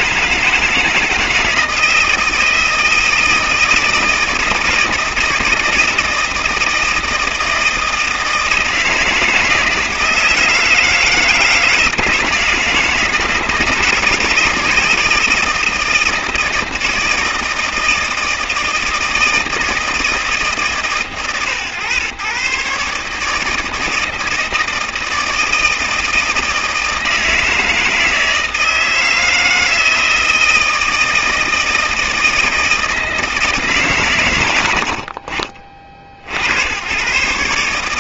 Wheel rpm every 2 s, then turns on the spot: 160, 160, 160, 160, 160, 160, 160, 160, 160, 160, 150, 140, 160, 160, 160, 160, 160, 90, 90.
none